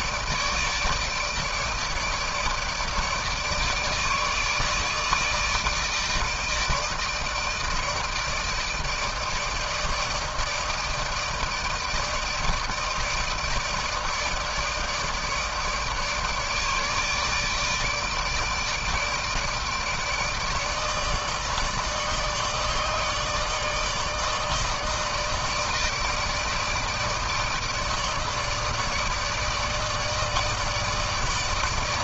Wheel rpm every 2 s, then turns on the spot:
150, 150, 150, 160, 160, 160, 160, 160, 150, 160, 160, 150, 160, 160, 160, 160.
none